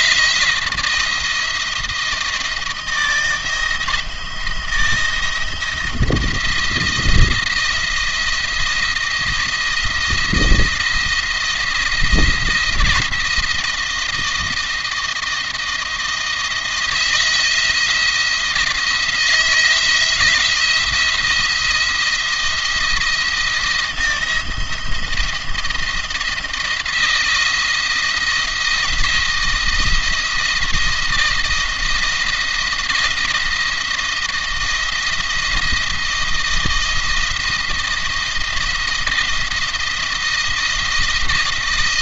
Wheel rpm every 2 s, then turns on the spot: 170, 170, 170, 170, 170, 170, 170, 170, 170, 170, 170, 170, 170, 160, 170, 170, 160, 170, 170, 170, 170.
none